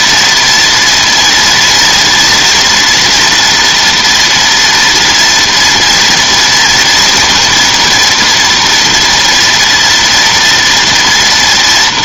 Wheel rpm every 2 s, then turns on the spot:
230, 240, 230, 230, 230, 230.
none